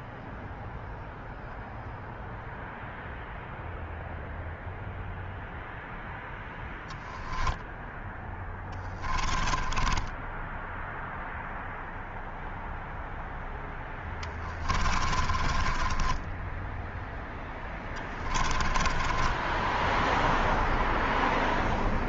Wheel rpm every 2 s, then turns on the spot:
0, 0, 0, 0, 20, 0, 0, 30, 0, 20, 0.
8-10 14-16 18-20